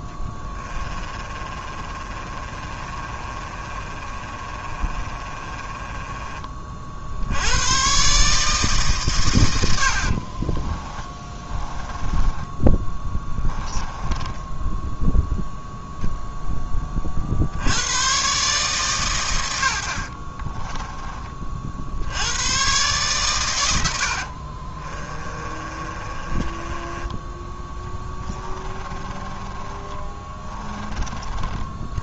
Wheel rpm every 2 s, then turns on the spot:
20, 30, 30, 40, 150, 20, 10, 10, 10, 140, 20, 120, 40, 20, 20, 20.
0-6 10-16 20-22 24-32